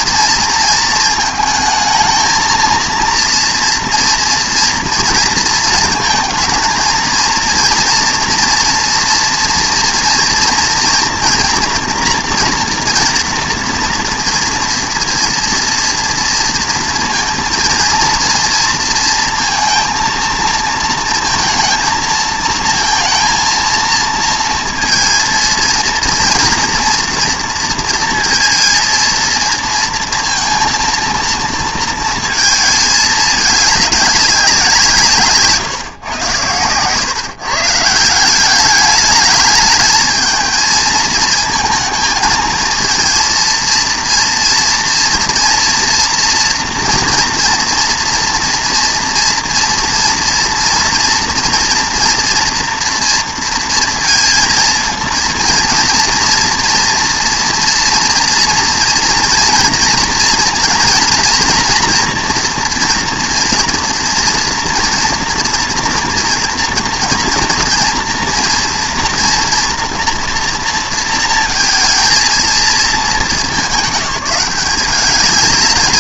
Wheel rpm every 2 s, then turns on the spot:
230, 230, 230, 230, 230, 230, 230, 230, 230, 230, 230, 230, 230, 230, 230, 230, 220, 170, 130, 210, 220, 230, 230, 240, 230, 240, 240, 230, 240, 230, 230, 230, 230, 230, 230, 230, 220, 190.
none